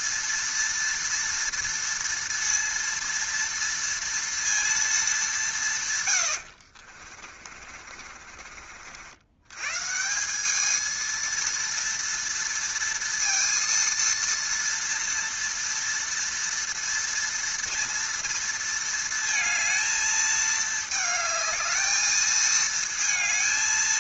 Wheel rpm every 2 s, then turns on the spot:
230, 230, 230, 80, 50, 210, 230, 230, 230, 230, 220, 220.
6-8